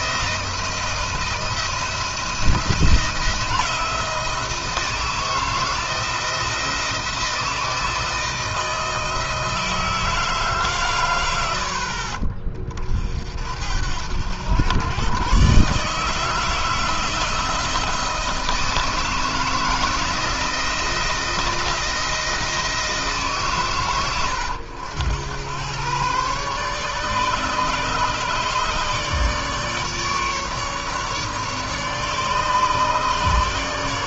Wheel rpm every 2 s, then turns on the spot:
170, 170, 160, 160, 160, 140, 40, 100, 160, 160, 170, 160, 100, 140, 150, 150, 150.
none